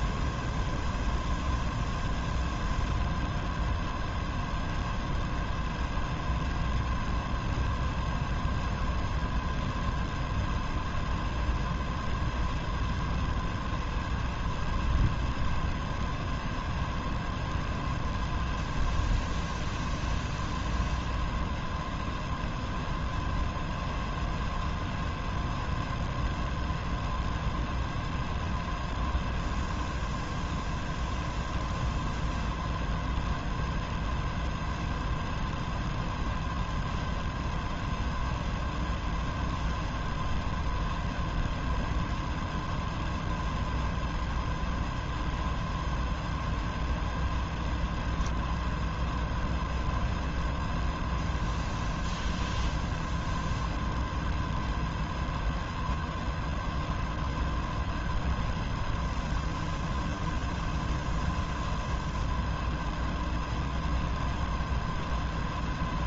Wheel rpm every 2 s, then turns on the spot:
0, 0, 0, 0, 0, 0, 0, 0, 0, 0, 0, 0, 0, 0, 0, 0, 0, 0, 0, 0, 0, 0, 0, 0, 0, 0, 0, 0, 0, 0, 0, 0, 0.
none